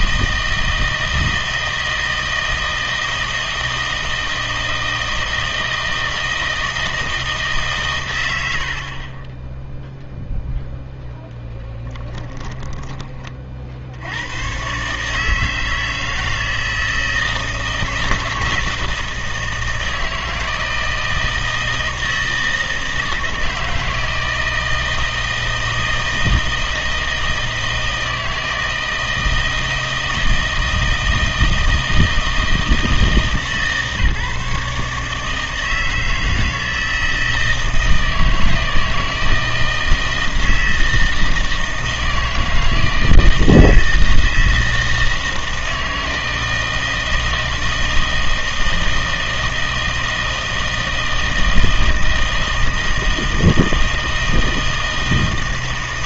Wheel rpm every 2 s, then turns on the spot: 160, 160, 160, 160, 60, 0, 30, 130, 160, 160, 160, 160, 160, 160, 160, 160, 160, 150, 160, 160, 160, 160, 160, 160, 160, 160, 160, 160.
12-14